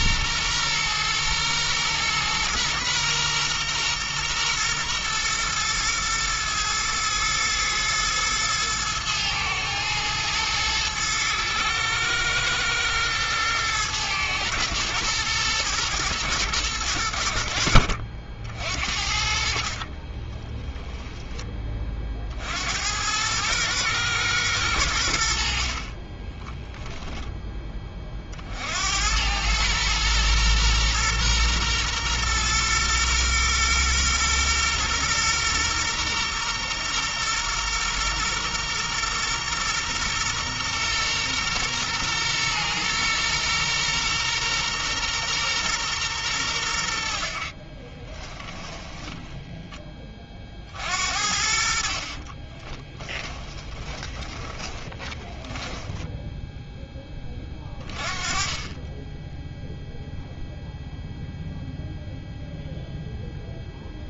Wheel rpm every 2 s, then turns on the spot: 120, 120, 120, 110, 110, 110, 110, 110, 100, 60, 10, 90, 90, 10, 80, 120, 120, 120, 120, 120, 120, 120, 120, 70, 10, 60, 10, 10, 10, 10, 0, 0.
48-50 52-56